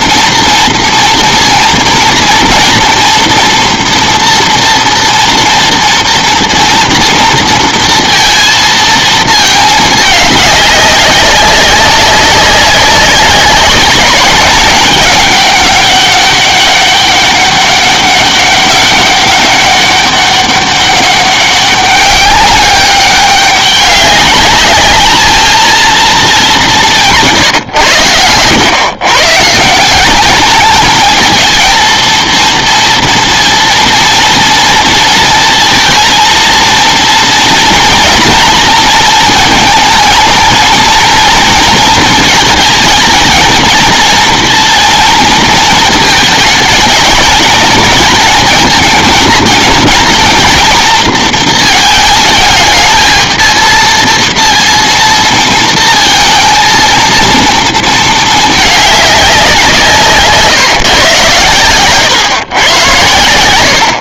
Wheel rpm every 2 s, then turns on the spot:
230, 230, 230, 230, 230, 200, 190, 200, 200, 200, 200, 200, 200, 210, 120, 210, 230, 230, 230, 230, 220, 230, 230, 220, 220, 230, 220, 230, 230, 220, 160, 110.
none